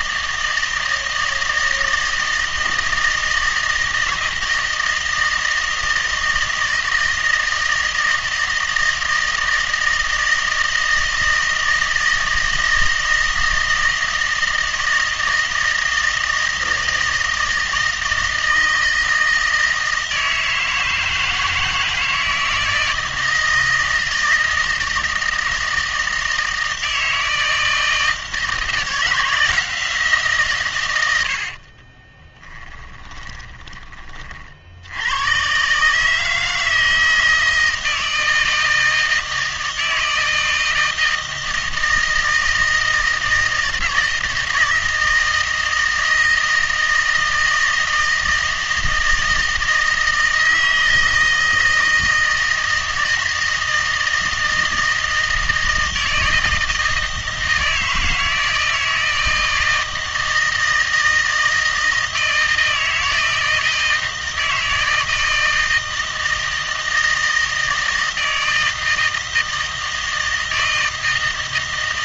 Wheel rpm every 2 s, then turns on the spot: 160, 160, 160, 160, 160, 160, 160, 160, 160, 160, 160, 160, 160, 160, 160, 120, 20, 70, 160, 160, 160, 160, 160, 160, 160, 160, 160, 160, 160, 160, 160, 160, 160, 160, 160, 160.
32-34